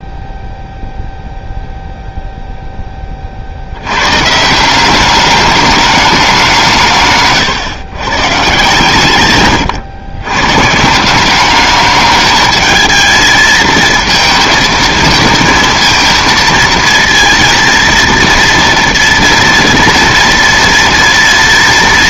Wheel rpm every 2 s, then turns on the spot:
0, 0, 170, 170, 150, 150, 220, 230, 230, 230, 230.
none